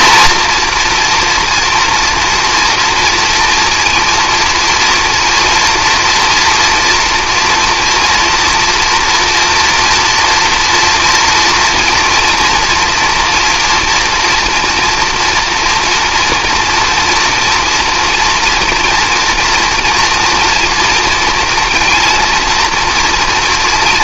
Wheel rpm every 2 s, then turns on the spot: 240, 230, 230, 230, 230, 240, 230, 230, 230, 240, 230, 240.
none